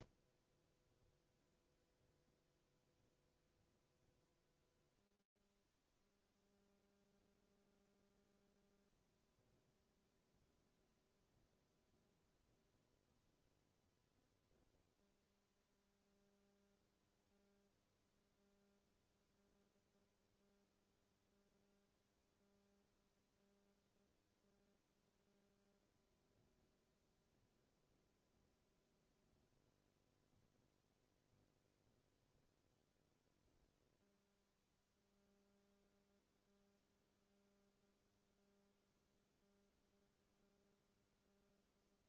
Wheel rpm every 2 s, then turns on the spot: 0, 0, 0, 0, 0, 0, 0, 0, 0, 0, 0, 0, 0, 0, 0, 0, 0, 0, 0, 0, 0.
none